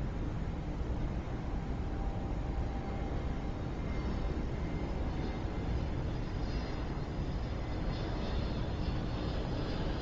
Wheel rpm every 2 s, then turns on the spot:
0, 0, 0, 0, 0.
none